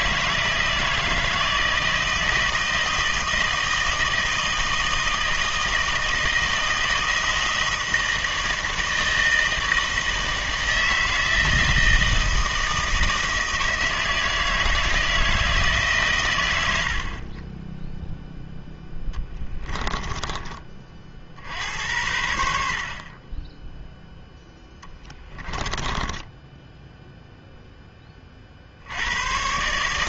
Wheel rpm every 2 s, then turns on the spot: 160, 160, 160, 160, 160, 160, 160, 160, 40, 10, 50, 30, 10, 0, 70.
16-20 24-26